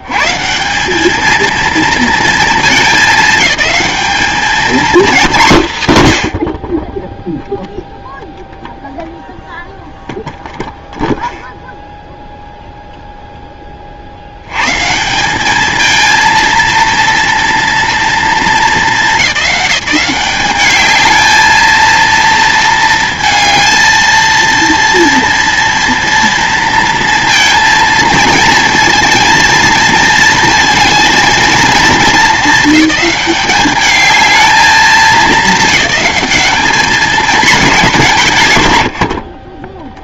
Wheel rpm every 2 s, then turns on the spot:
170, 220, 220, 50, 0, 0, 0, 140, 230, 220, 210, 230, 230, 230, 230, 230, 210, 210, 210, 110.
none